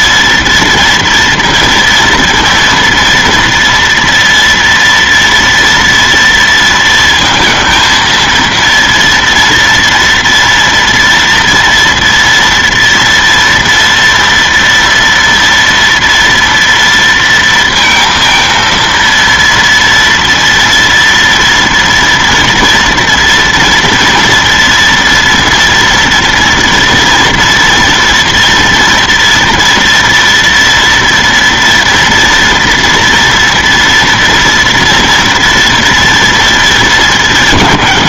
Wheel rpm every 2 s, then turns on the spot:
230, 230, 230, 230, 230, 230, 230, 230, 230, 230, 230, 230, 230, 230, 230, 230, 240, 230, 220.
none